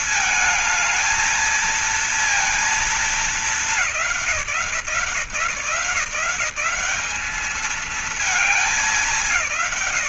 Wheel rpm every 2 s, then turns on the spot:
220, 230, 170, 150, 210.
none